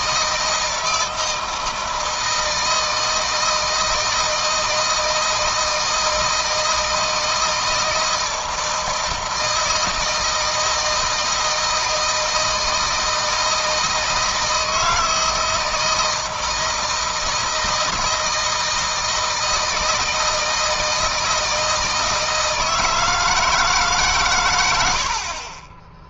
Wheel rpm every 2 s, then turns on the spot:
160, 160, 160, 160, 160, 160, 160, 160, 160, 160, 160, 160, 100.
none